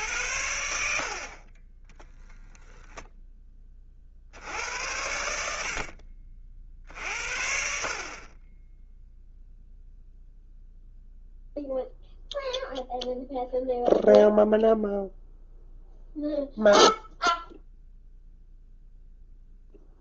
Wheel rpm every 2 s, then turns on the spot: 70, 0, 80, 50, 10, 0, 0, 0, 0, 0.
none